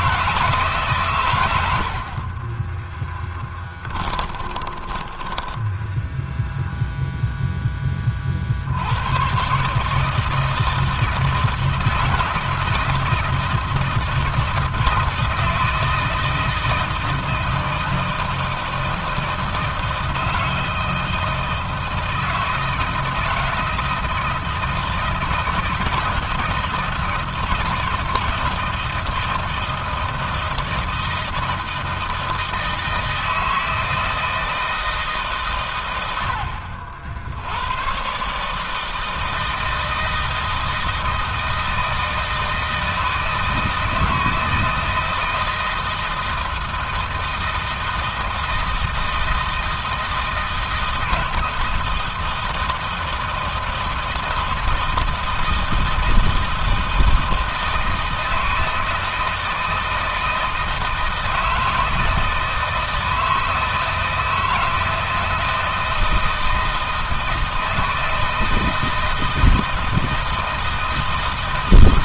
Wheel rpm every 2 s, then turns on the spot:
130, 20, 20, 0, 80, 160, 160, 160, 170, 160, 160, 160, 160, 160, 160, 160, 160, 150, 70, 160, 160, 160, 160, 160, 160, 160, 160, 160, 160, 160, 160, 160, 160, 160, 160, 160.
2-6